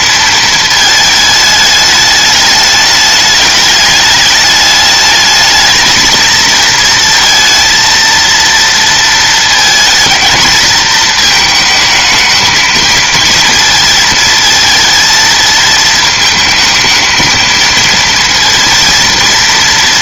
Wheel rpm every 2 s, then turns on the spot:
220, 210, 210, 230, 230, 220, 220, 230, 220, 230.
none